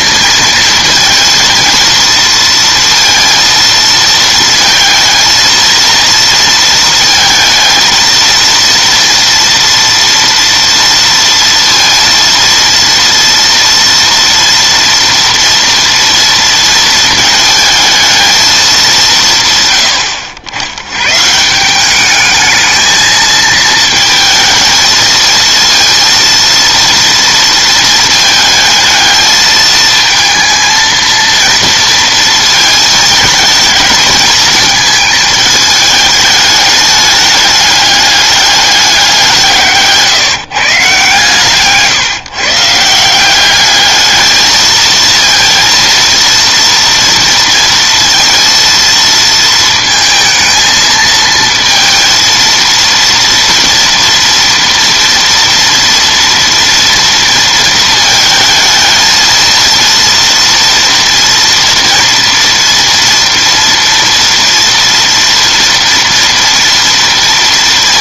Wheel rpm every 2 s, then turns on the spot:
230, 230, 230, 230, 230, 230, 230, 230, 230, 210, 90, 220, 220, 230, 220, 220, 220, 220, 210, 200, 150, 150, 220, 230, 230, 220, 230, 240, 230, 220, 230, 240, 230, 230.
none